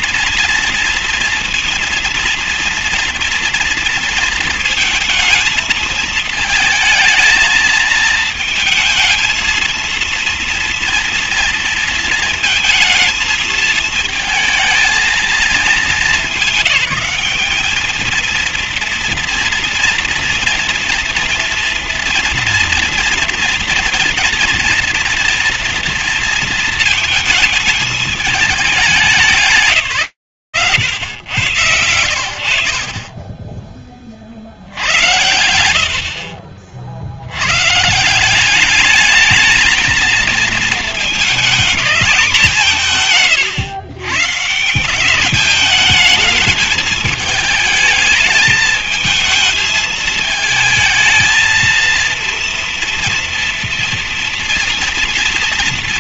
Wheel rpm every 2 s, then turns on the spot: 230, 230, 230, 220, 220, 230, 220, 220, 210, 230, 230, 230, 230, 230, 200, 100, 20, 80, 60, 210, 220, 170, 170, 220, 220, 220, 230, 230.
none